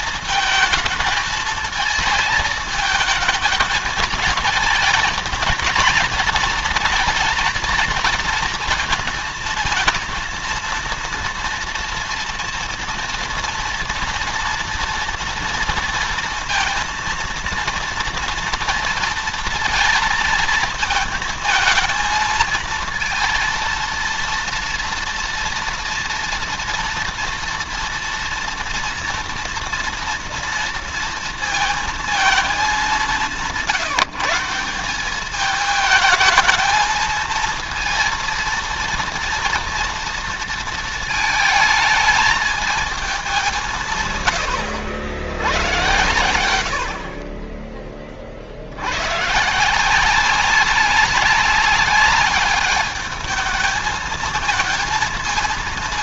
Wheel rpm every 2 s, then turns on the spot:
220, 220, 220, 230, 220, 230, 230, 230, 230, 230, 220, 230, 230, 230, 230, 230, 190, 190, 220, 230, 230, 220, 140, 60, 90, 200, 210, 220.
none